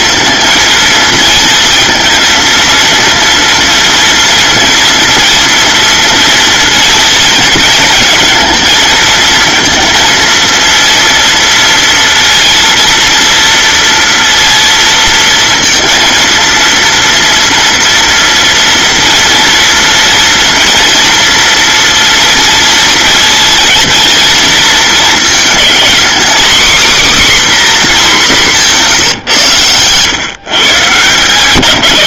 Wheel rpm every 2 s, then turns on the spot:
230, 230, 230, 230, 230, 230, 230, 230, 230, 230, 230, 230, 220, 270, 190, 140.
28-30